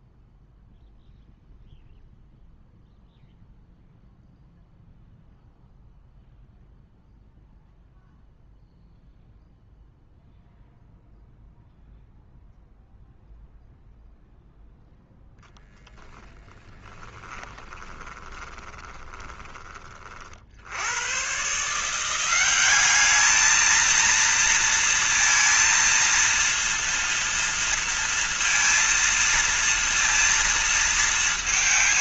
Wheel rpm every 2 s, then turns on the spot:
0, 0, 0, 0, 0, 0, 0, 0, 10, 20, 60, 190, 230, 230, 230, 230.
16-20